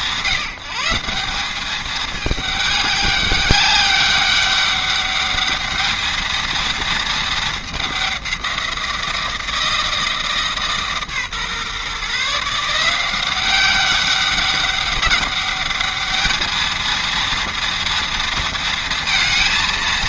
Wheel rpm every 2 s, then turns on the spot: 170, 210, 200, 220, 180, 150, 160, 190, 230, 230.
none